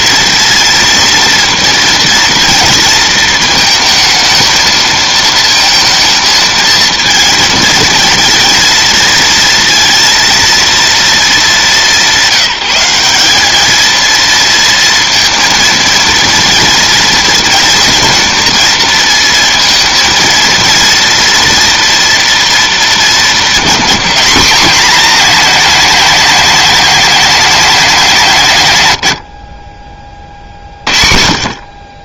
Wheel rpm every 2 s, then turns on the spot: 230, 230, 220, 220, 230, 230, 190, 230, 230, 230, 230, 220, 230, 230, 120, 60.
none